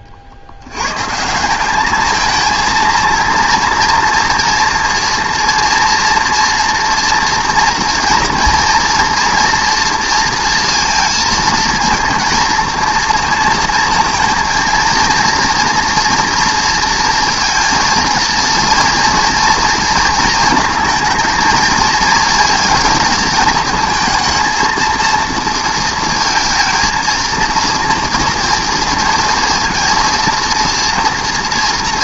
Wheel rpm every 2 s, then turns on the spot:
90, 220, 230, 230, 230, 230, 230, 230, 230, 230, 230, 220, 230, 220, 230, 230.
none